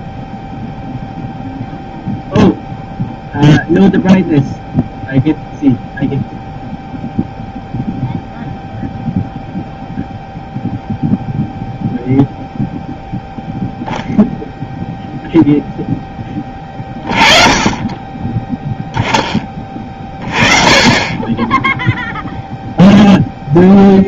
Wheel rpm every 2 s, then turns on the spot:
0, 0, 0, 0, 0, 0, 0, 0, 20, 10, 40, 0.
none